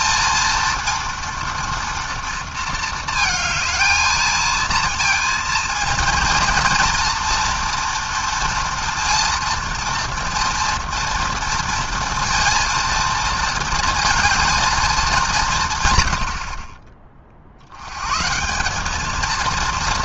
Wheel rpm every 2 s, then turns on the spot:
230, 220, 230, 240, 230, 230, 230, 210, 50, 230.
none